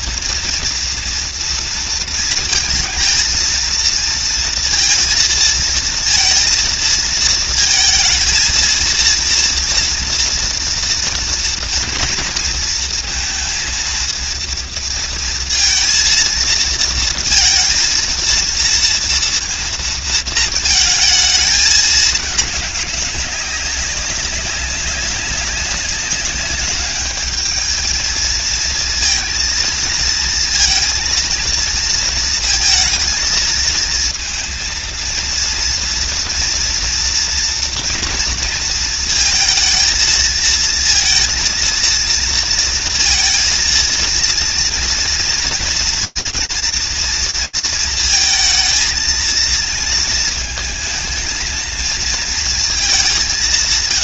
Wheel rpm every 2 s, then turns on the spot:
230, 230, 230, 230, 230, 240, 230, 230, 230, 230, 220, 210, 200, 200, 230, 230, 230, 230, 240, 230, 220, 230, 230, 230, 220, 220, 230.
none